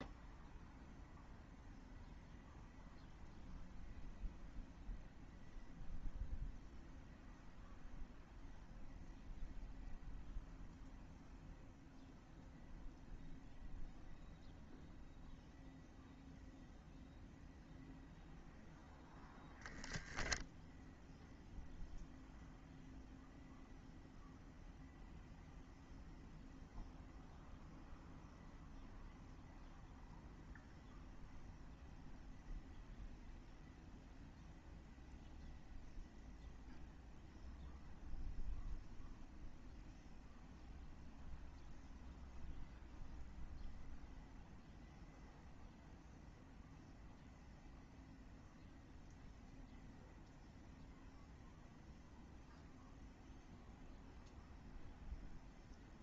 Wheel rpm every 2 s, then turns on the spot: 0, 0, 0, 0, 0, 0, 0, 0, 0, 0, 0, 0, 0, 0, 0, 0, 0, 0, 0, 0, 0, 0, 0, 0, 0, 0, 0, 0.
none